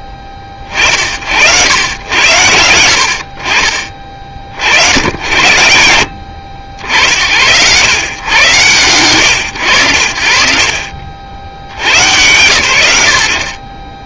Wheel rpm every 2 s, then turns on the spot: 40, 80, 50, 60, 110, 50, 80.
none